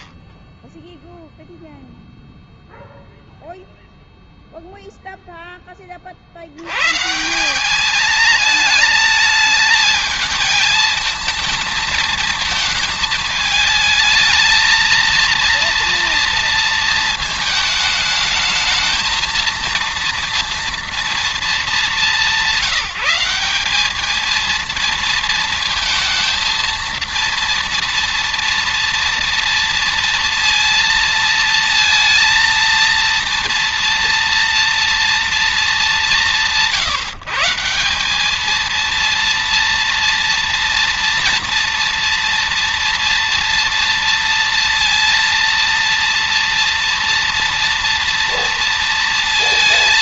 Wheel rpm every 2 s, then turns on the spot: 0, 0, 0, 150, 220, 220, 220, 230, 230, 230, 230, 180, 230, 230, 230, 230, 230, 230, 150, 230, 230, 230, 230, 230, 230.
none